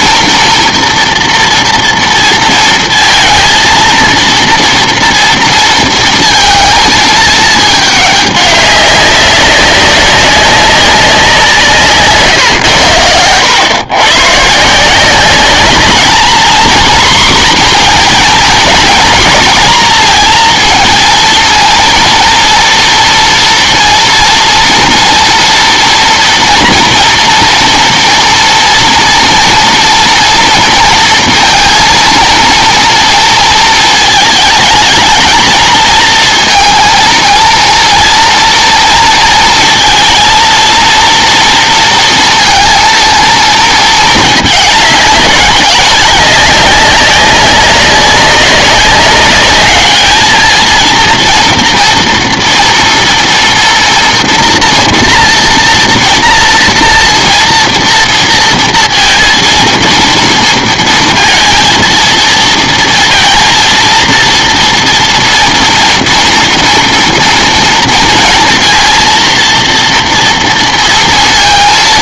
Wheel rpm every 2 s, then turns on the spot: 240, 230, 230, 220, 200, 190, 100, 160, 240, 240, 230, 230, 230, 230, 230, 230, 230, 220, 230, 230, 230, 230, 210, 200, 200, 220, 230, 240, 230, 230, 230, 230, 230, 230, 230, 230.
none